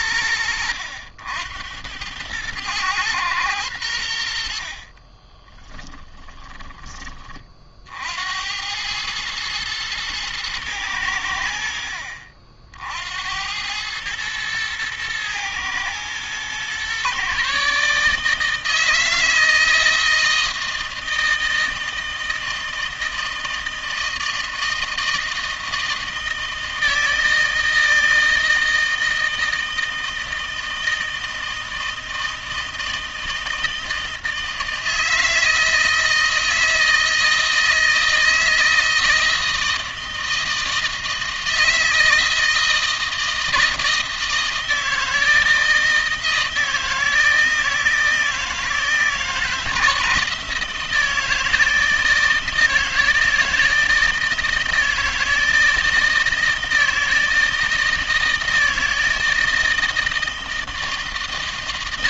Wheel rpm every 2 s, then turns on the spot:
70, 110, 50, 30, 100, 100, 60, 110, 130, 160, 160, 160, 160, 160, 160, 160, 160, 160, 160, 160, 160, 160, 160, 160, 160, 160, 160, 160, 160, 160, 160.
4-6